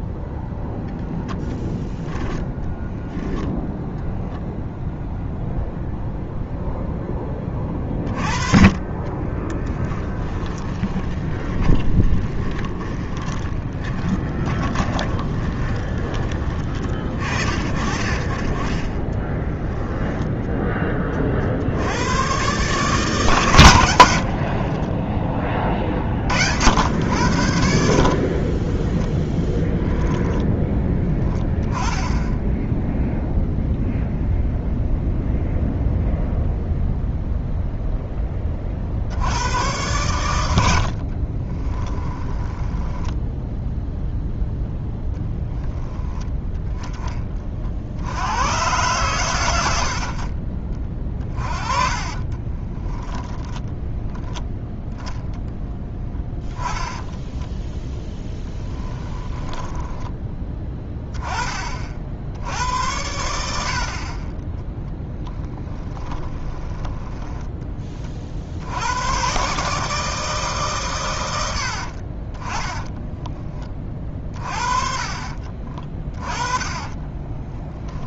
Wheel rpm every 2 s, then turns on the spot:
0, 0, 0, 0, 30, 20, 20, 20, 30, 30, 20, 140, 40, 80, 20, 10, 10, 0, 0, 40, 80, 10, 0, 10, 110, 30, 20, 0, 10, 10, 10, 80, 10, 10, 70, 140, 20, 30, 40.
10-16 24-26 28-30 42-44 52-54 56-60 64-68 76-78